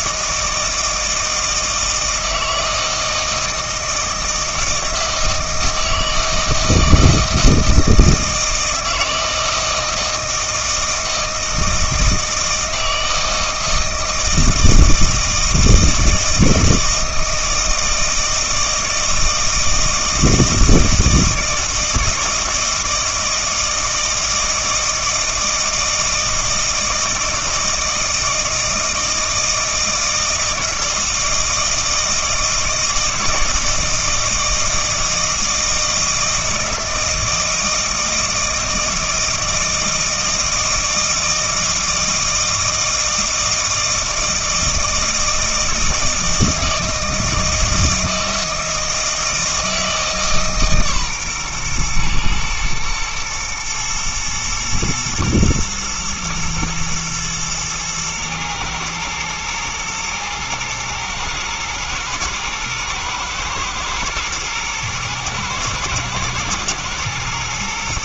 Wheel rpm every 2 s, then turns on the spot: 160, 160, 160, 160, 160, 160, 160, 160, 160, 160, 160, 160, 160, 160, 160, 160, 160, 160, 160, 160, 160, 160, 160, 160, 160, 140, 120, 110, 120, 110, 120, 120, 110, 110.
none